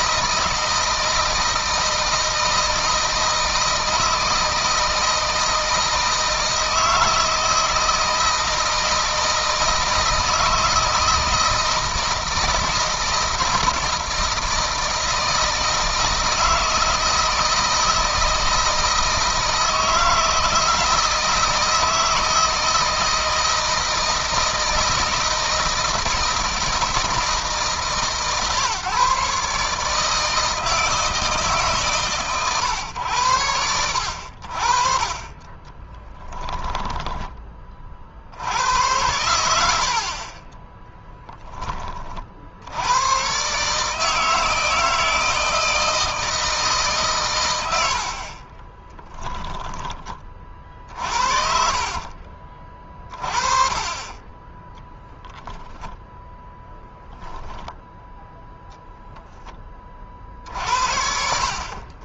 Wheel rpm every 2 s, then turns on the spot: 160, 160, 160, 160, 160, 160, 160, 160, 160, 160, 160, 160, 160, 160, 150, 160, 100, 50, 20, 100, 20, 100, 160, 140, 10, 40, 30, 10, 0, 10, 70.
36-38 40-42 48-52